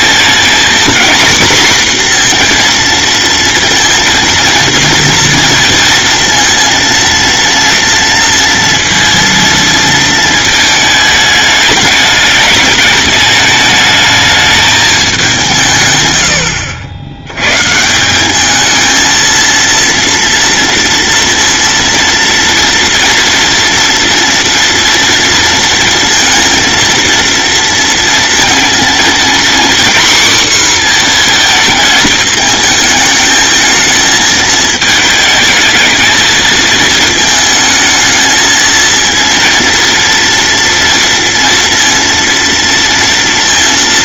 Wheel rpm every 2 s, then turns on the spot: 240, 230, 230, 230, 230, 220, 210, 210, 70, 220, 230, 230, 230, 230, 230, 250, 220, 220, 230, 220, 230, 230.
none